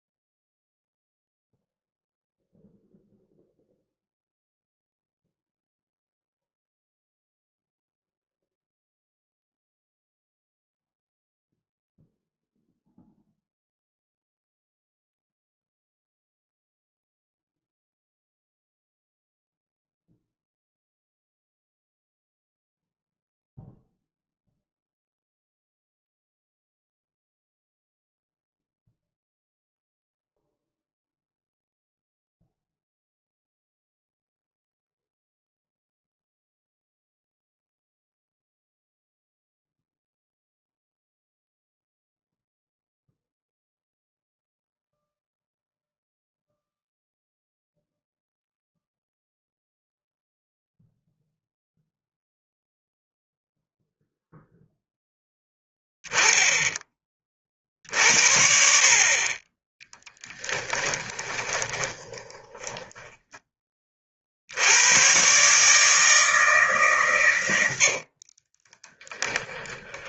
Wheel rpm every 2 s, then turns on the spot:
0, 0, 0, 0, 0, 0, 0, 0, 0, 0, 0, 0, 0, 0, 0, 0, 0, 0, 0, 0, 0, 0, 0, 0, 0, 0, 0, 0, 10, 50, 10, 20, 90, 150, 30.
60-64 68-70